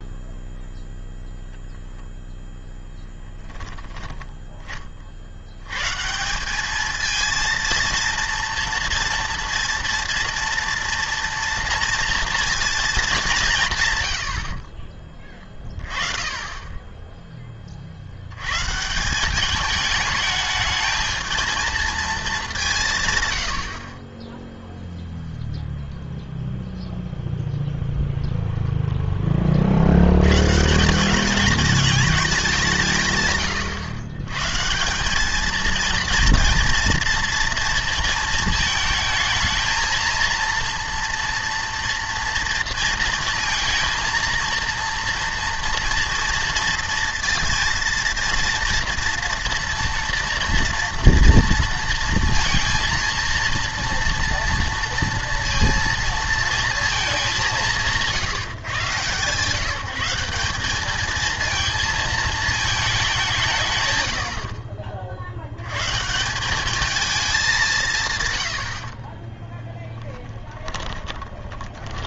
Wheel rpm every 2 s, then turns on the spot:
0, 0, 30, 210, 230, 230, 230, 40, 10, 140, 220, 170, 0, 0, 0, 170, 170, 180, 230, 220, 230, 230, 230, 230, 230, 230, 230, 230, 230, 150, 200, 210, 50, 210, 60, 20.
14-16 64-66 70-72